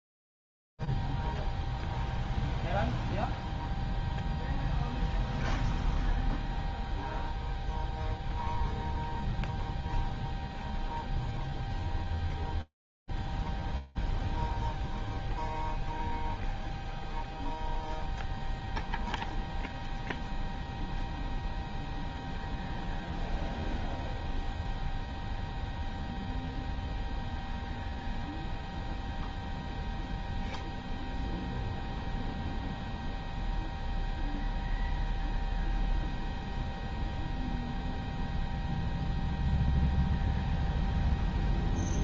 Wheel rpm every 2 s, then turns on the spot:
0, 0, 0, 0, 0, 0, 0, 0, 0, 0, 0, 0, 0, 0, 10, 0, 0, 0, 0, 0, 0.
none